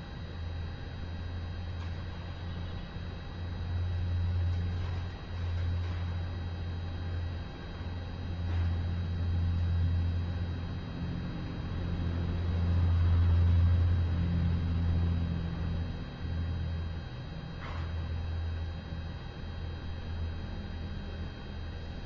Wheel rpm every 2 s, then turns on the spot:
0, 0, 0, 0, 0, 0, 0, 0, 0, 0, 0.
none